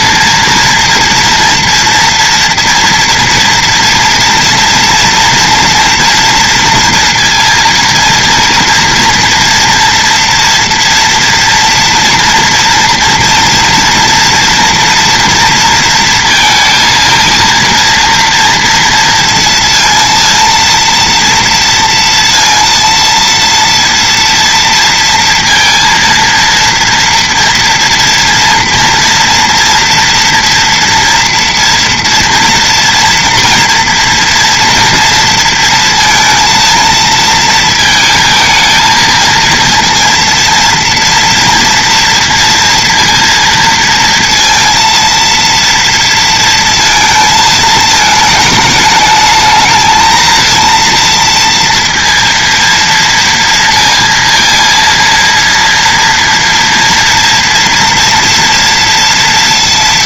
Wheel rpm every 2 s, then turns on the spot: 230, 230, 230, 230, 230, 230, 230, 240, 230, 230, 230, 230, 230, 230, 230, 230, 240, 230, 230, 230, 230, 240, 230, 230, 210, 230, 230, 230, 230, 230.
none